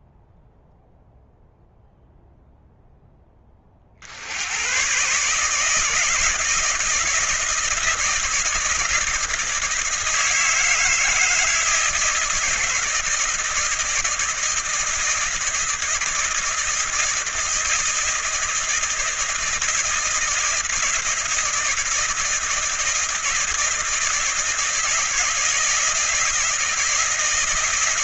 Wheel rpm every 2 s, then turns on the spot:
0, 0, 120, 160, 160, 160, 160, 160, 160, 160, 160, 160, 160, 160.
none